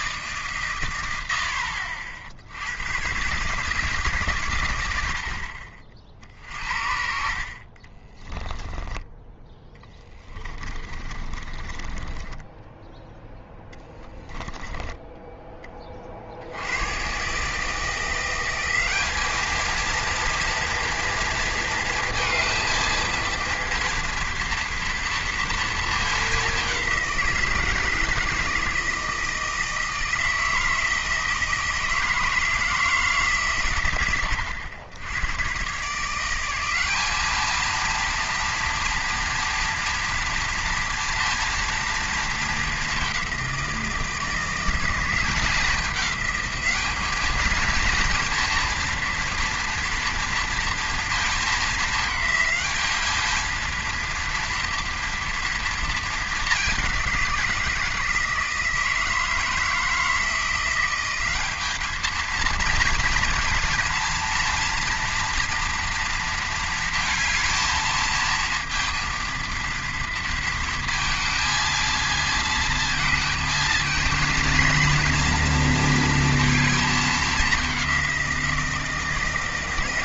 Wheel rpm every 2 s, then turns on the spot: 140, 90, 110, 50, 10, 20, 10, 10, 90, 190, 230, 230, 230, 200, 160, 160, 160, 100, 190, 230, 230, 210, 170, 210, 230, 230, 220, 230, 200, 160, 170, 220, 230, 230, 230, 230, 230, 230, 230, 170.
8-16